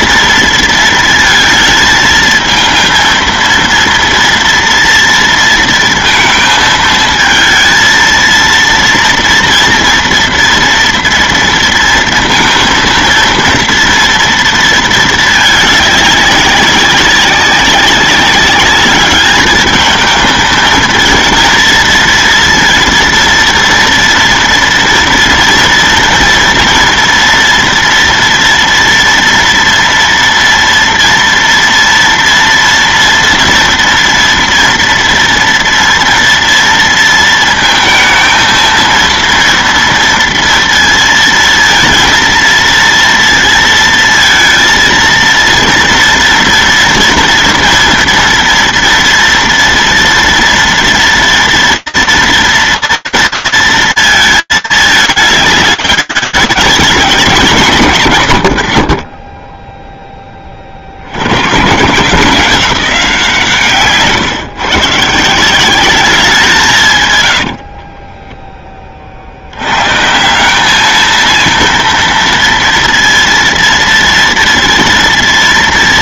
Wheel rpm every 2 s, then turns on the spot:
230, 220, 230, 220, 230, 230, 230, 230, 200, 200, 220, 230, 230, 240, 240, 230, 230, 230, 230, 230, 230, 230, 230, 230, 230, 230, 230, 220, 200, 120, 40, 180, 140, 190, 20, 200, 230, 230.
none